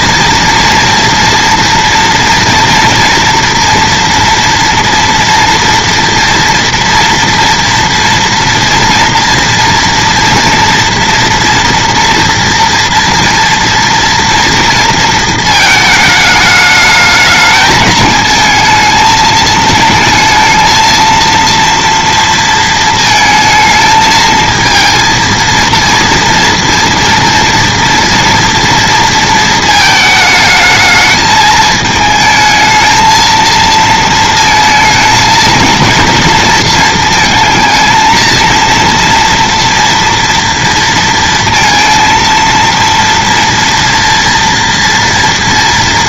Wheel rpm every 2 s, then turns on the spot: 230, 230, 240, 230, 230, 230, 230, 230, 210, 220, 220, 230, 220, 230, 230, 220, 220, 220, 230, 230, 230, 230, 240.
none